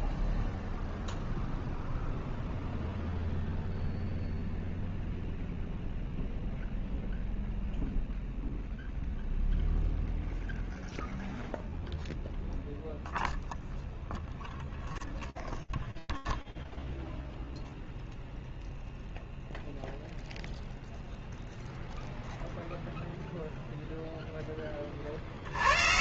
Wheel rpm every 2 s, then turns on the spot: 0, 0, 0, 0, 0, 0, 0, 0, 0, 0, 0, 0, 160.
none